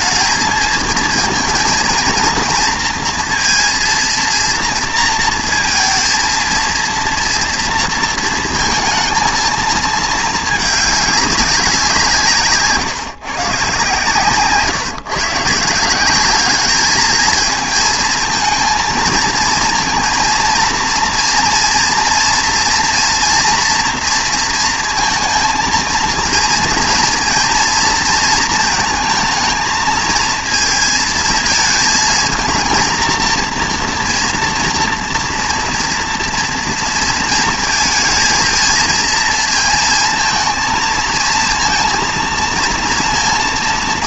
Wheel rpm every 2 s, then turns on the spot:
230, 230, 230, 230, 220, 210, 140, 140, 210, 230, 230, 240, 230, 230, 230, 220, 220, 230, 230, 230, 230, 230.
none